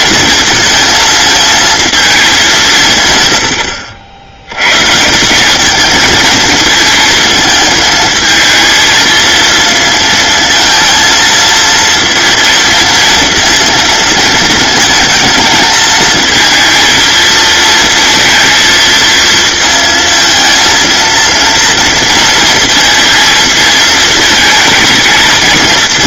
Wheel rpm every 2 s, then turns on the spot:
220, 180, 130, 220, 220, 230, 230, 230, 230, 230, 230, 230, 230.
none